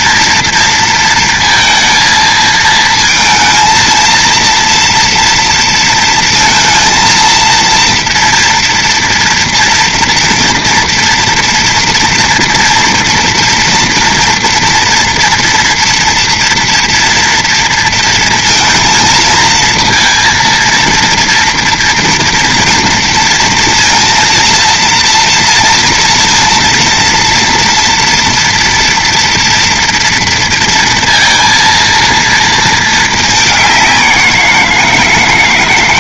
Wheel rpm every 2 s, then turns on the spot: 230, 220, 230, 230, 240, 240, 230, 240, 230, 230, 230, 230, 230, 230, 240, 230, 230, 170.
none